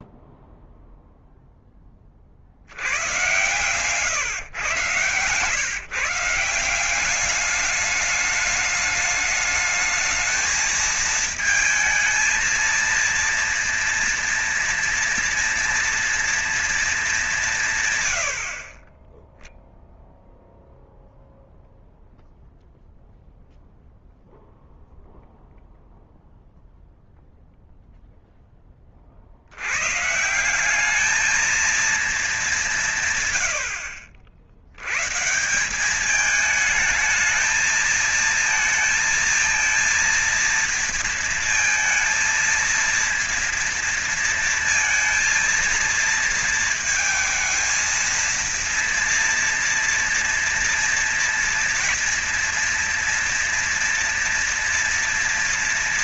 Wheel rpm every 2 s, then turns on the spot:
0, 90, 130, 180, 210, 220, 230, 230, 220, 40, 0, 0, 0, 0, 30, 190, 150, 110, 210, 230, 230, 230, 230, 230, 230, 230, 230, 230.
none